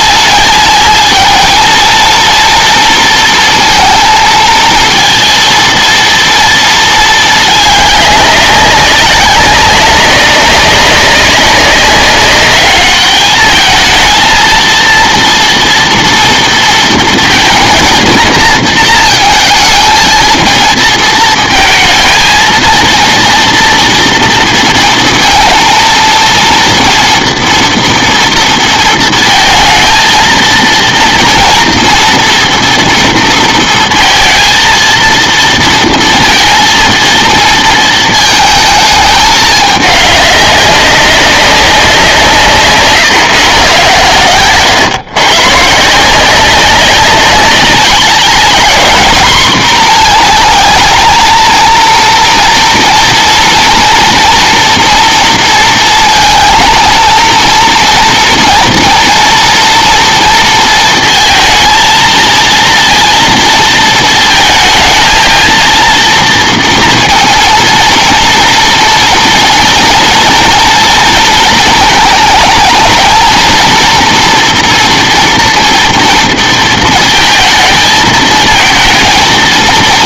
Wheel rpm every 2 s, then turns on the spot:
220, 240, 220, 230, 200, 200, 210, 230, 230, 220, 230, 230, 230, 230, 230, 230, 240, 230, 230, 220, 200, 150, 120, 190, 220, 230, 230, 230, 230, 230, 230, 230, 220, 230, 230, 230, 220, 230, 230, 220.
none